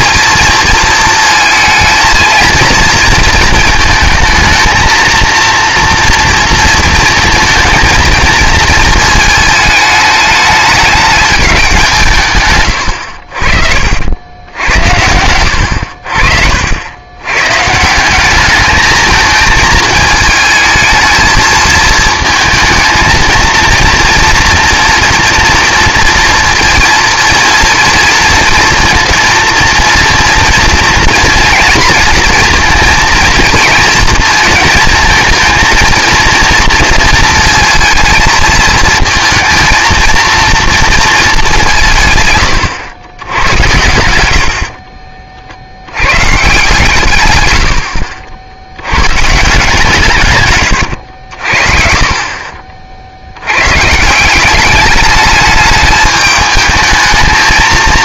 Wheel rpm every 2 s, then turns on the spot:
230, 230, 230, 230, 230, 210, 110, 80, 70, 210, 220, 220, 230, 230, 230, 230, 230, 230, 230, 220, 230, 110, 70, 130, 80, 110, 40, 190, 220.
none